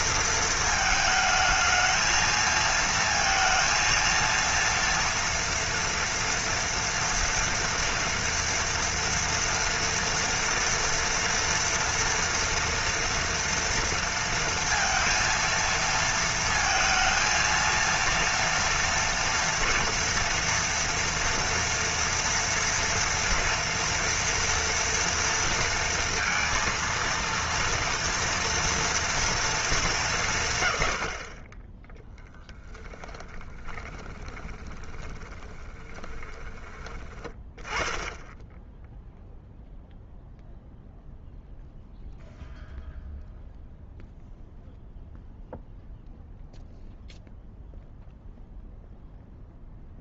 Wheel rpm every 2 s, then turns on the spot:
230, 220, 230, 230, 230, 230, 230, 230, 230, 230, 230, 230, 230, 230, 230, 130, 10, 20, 20, 10, 0, 0, 0, 0, 0.
32-36